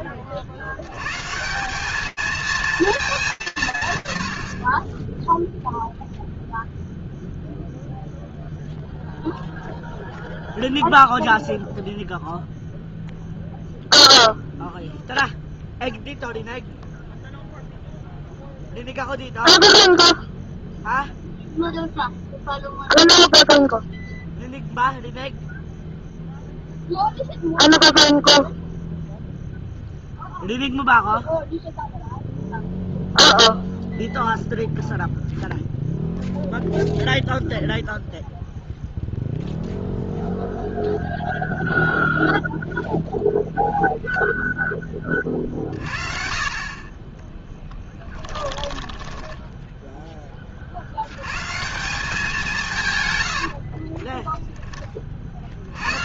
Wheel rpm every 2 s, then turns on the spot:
60, 220, 110, 0, 0, 0, 0, 0, 0, 0, 0, 0, 0, 0, 0, 0, 0, 0, 0, 0, 0, 0, 20, 20, 10, 50, 200, 10.
48-50